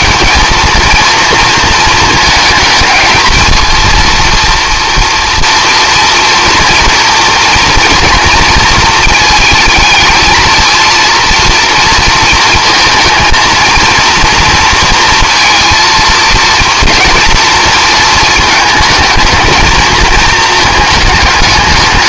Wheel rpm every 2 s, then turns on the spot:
230, 220, 230, 230, 230, 220, 220, 230, 230, 220, 220.
none